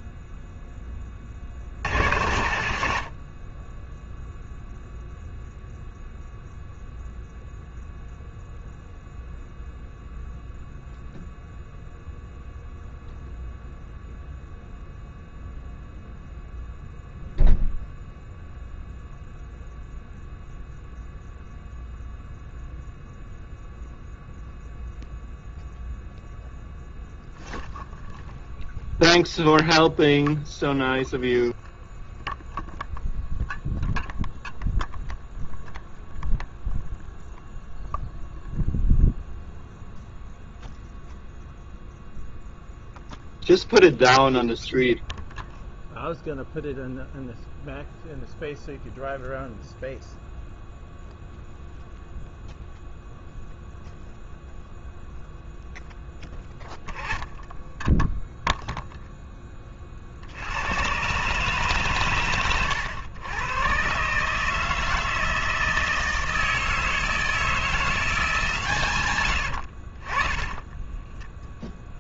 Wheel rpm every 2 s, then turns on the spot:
10, 70, 0, 0, 0, 0, 0, 0, 0, 0, 0, 0, 0, 0, 0, 0, 0, 0, 0, 0, 0, 0, 0, 0, 0, 0, 0, 0, 10, 0, 100, 110, 160, 160, 150, 10.
70-72